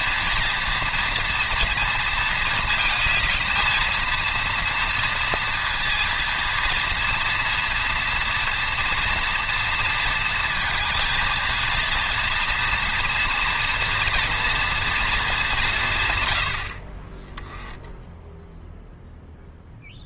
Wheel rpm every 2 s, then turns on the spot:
230, 220, 230, 230, 230, 230, 240, 230, 70, 0.
none